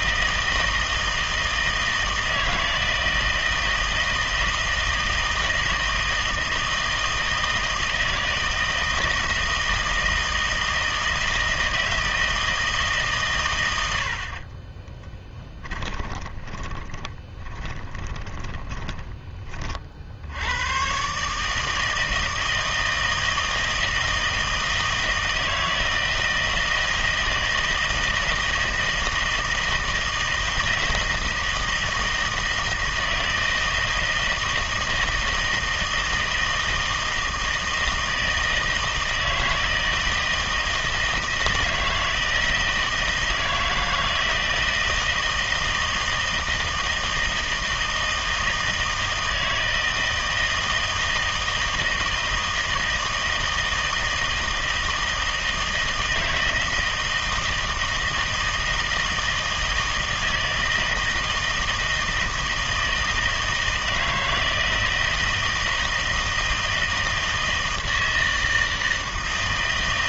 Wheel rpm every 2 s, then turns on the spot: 160, 160, 160, 160, 160, 160, 150, 20, 20, 30, 110, 160, 160, 160, 160, 160, 160, 160, 160, 160, 160, 160, 160, 160, 160, 160, 160, 160, 160, 160, 160, 160, 160, 160, 160.
14-20